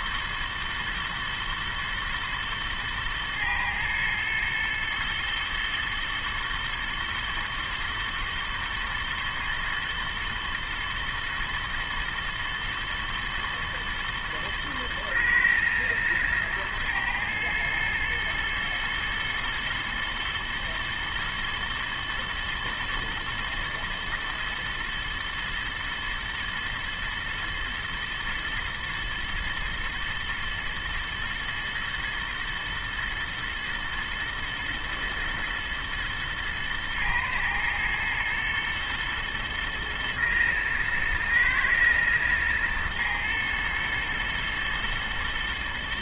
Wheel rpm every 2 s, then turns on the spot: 110, 110, 120, 120, 120, 110, 120, 110, 110, 120, 120, 120, 120, 110, 110, 110, 110, 110, 110, 120, 120, 120, 120.
none